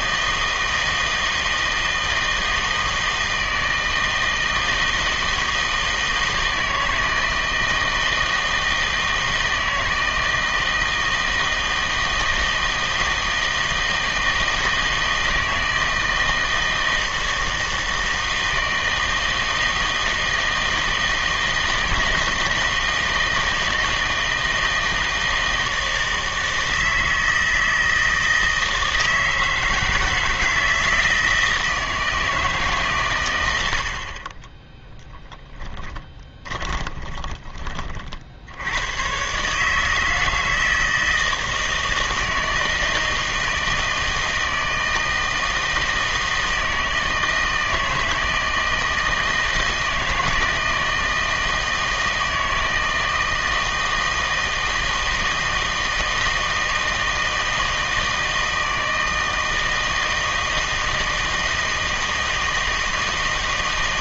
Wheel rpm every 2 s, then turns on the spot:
160, 160, 160, 160, 160, 160, 160, 160, 160, 160, 160, 160, 160, 160, 160, 160, 150, 20, 20, 80, 160, 160, 160, 160, 160, 160, 160, 160, 160, 160, 160, 160.
34-38